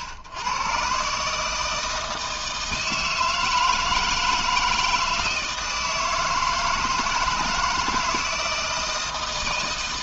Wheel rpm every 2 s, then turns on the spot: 110, 160, 160, 160, 160.
none